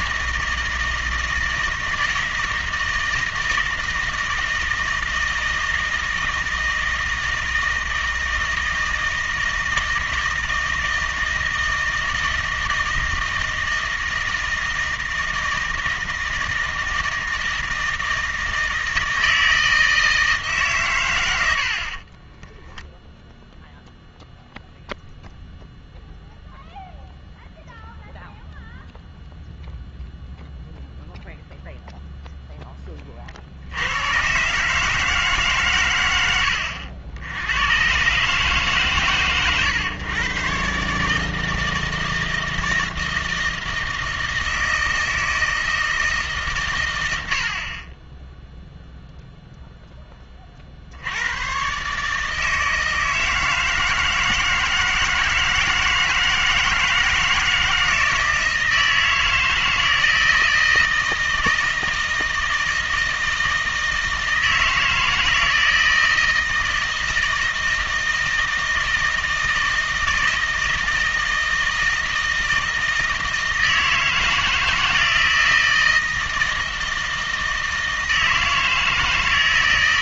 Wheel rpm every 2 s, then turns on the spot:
160, 160, 160, 160, 160, 160, 160, 160, 160, 160, 130, 0, 0, 0, 0, 0, 20, 150, 70, 130, 140, 160, 160, 110, 0, 60, 160, 160, 160, 160, 160, 160, 160, 160, 160, 160, 160, 160, 160, 160.
none